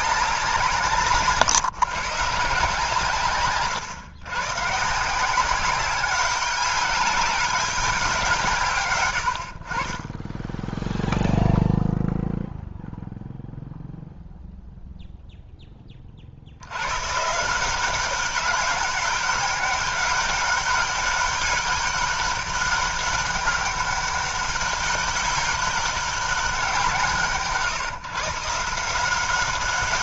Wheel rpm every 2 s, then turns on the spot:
180, 160, 150, 200, 140, 10, 0, 0, 90, 200, 200, 200, 200, 190, 160.
none